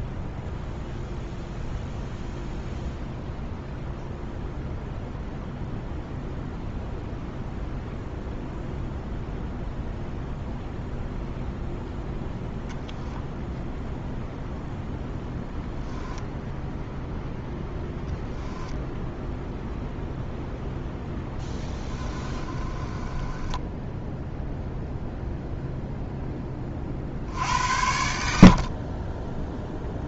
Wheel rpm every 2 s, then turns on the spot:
0, 0, 0, 0, 0, 0, 0, 0, 0, 0, 0, 20, 0, 40, 30.
22-24